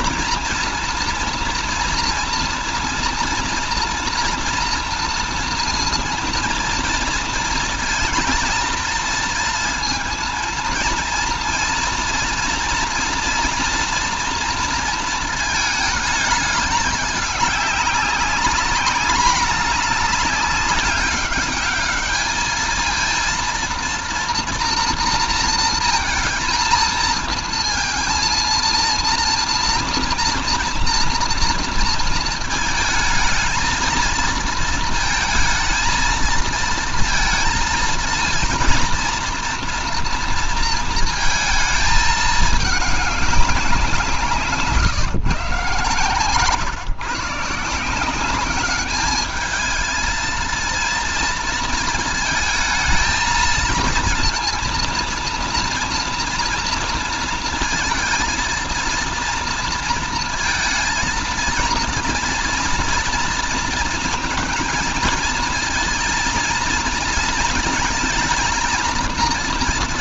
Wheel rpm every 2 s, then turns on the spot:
230, 230, 230, 230, 230, 230, 240, 230, 210, 200, 200, 220, 240, 230, 230, 230, 220, 230, 230, 230, 230, 210, 150, 130, 200, 230, 220, 230, 230, 230, 230, 230, 220, 220, 230.
none